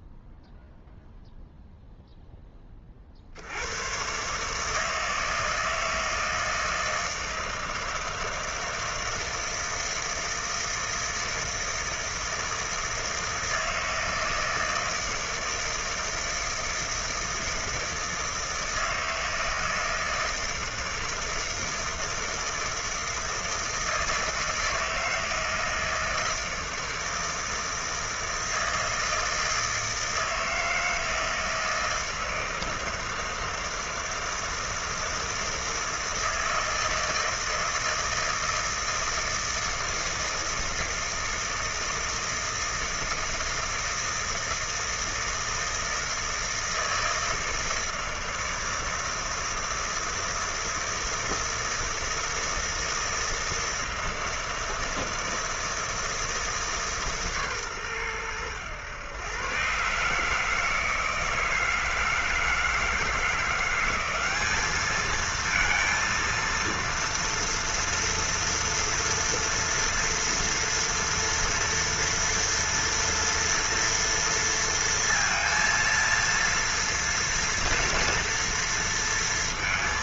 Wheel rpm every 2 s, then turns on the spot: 0, 0, 130, 160, 160, 160, 160, 160, 160, 160, 160, 160, 160, 160, 160, 160, 160, 160, 160, 160, 160, 160, 160, 160, 160, 160, 160, 160, 150, 110, 160, 160, 220, 230, 230, 230, 240, 230, 230, 230.
none